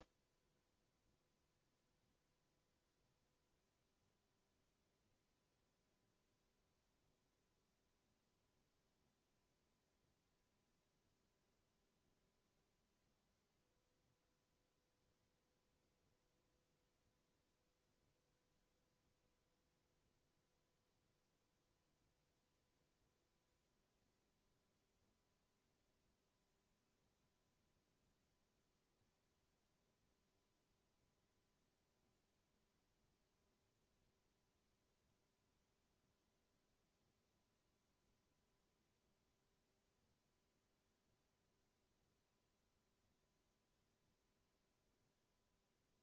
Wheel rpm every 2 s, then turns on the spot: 0, 0, 0, 0, 0, 0, 0, 0, 0, 0, 0, 0, 0, 0, 0, 0, 0, 0, 0, 0, 0, 0, 0.
none